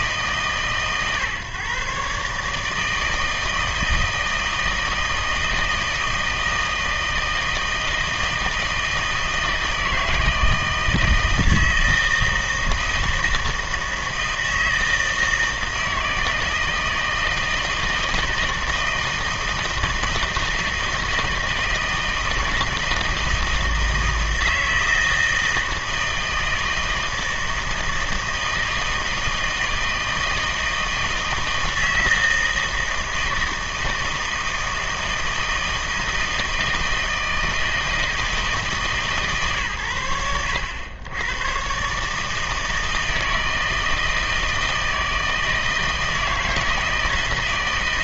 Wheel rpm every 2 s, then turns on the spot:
140, 150, 160, 160, 160, 160, 160, 160, 160, 160, 160, 160, 160, 160, 160, 160, 160, 160, 160, 150, 90, 160, 160, 160.
none